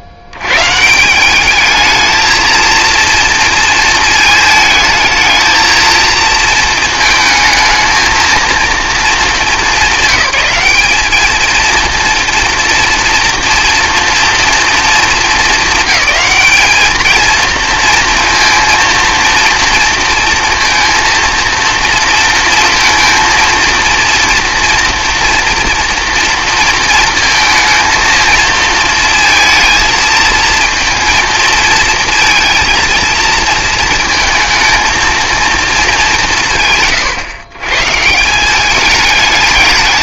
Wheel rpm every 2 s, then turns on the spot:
80, 230, 220, 220, 220, 200, 230, 230, 220, 230, 230, 230, 230, 230, 220, 230, 220, 220, 130, 200.
none